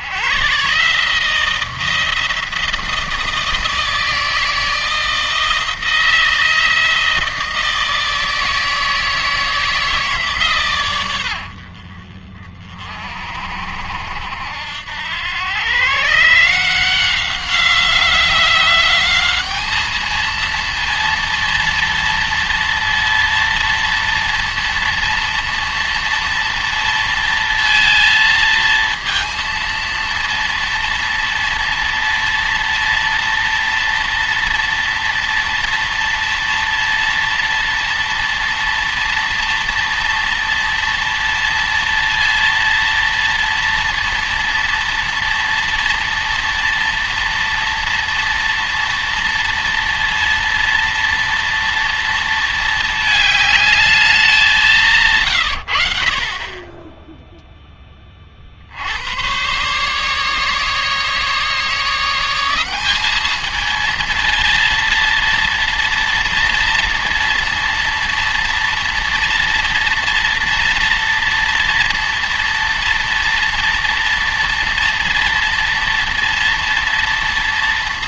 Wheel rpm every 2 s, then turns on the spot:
130, 170, 160, 170, 160, 130, 50, 80, 170, 190, 230, 230, 230, 230, 230, 230, 230, 230, 230, 240, 230, 230, 230, 230, 230, 230, 220, 180, 20, 60, 150, 190, 230, 230, 230, 230, 230, 230, 230.
none